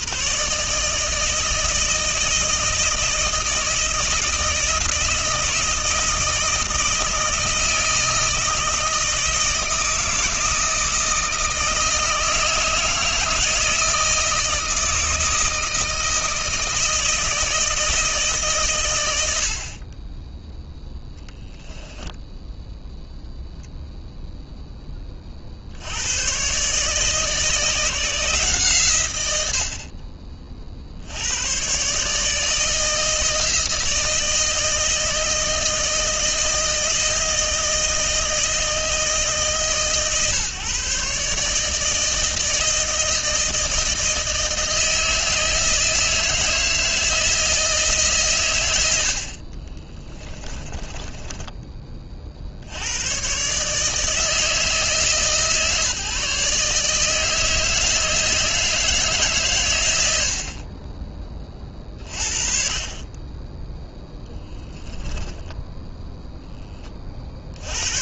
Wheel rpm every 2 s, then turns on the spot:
160, 160, 160, 160, 160, 160, 160, 160, 160, 120, 0, 0, 20, 150, 130, 70, 160, 160, 160, 160, 150, 160, 160, 160, 70, 20, 90, 160, 150, 160, 30, 30, 10, 30.
50-52 64-66